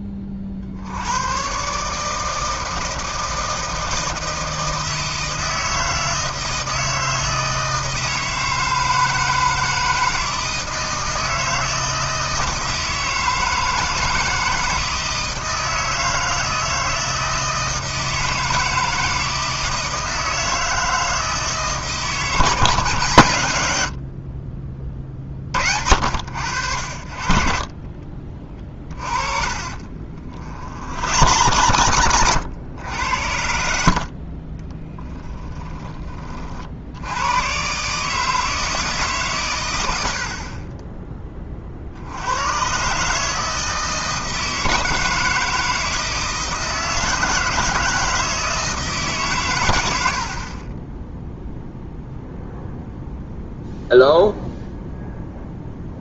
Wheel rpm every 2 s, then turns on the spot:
50, 160, 160, 160, 160, 160, 160, 160, 160, 160, 160, 150, 30, 70, 30, 70, 90, 10, 70, 160, 30, 130, 160, 160, 160, 20, 0, 0.
28-32 34-36 50-52